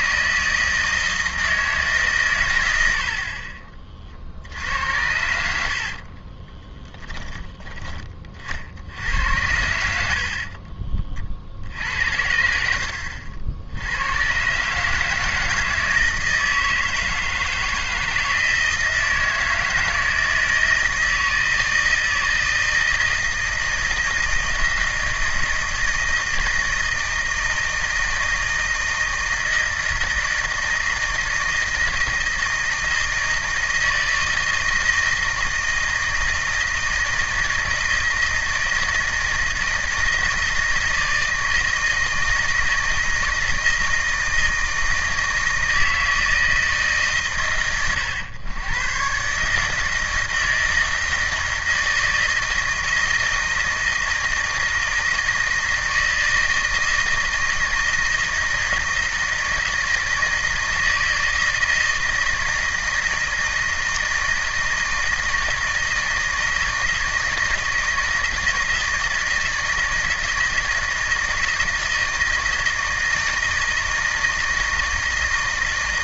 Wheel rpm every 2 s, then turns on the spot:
160, 90, 80, 20, 60, 40, 70, 140, 160, 160, 160, 160, 160, 160, 160, 160, 160, 160, 160, 160, 160, 160, 160, 160, 110, 160, 160, 160, 160, 160, 160, 160, 170, 160, 160, 160, 160, 160.
6-8 10-12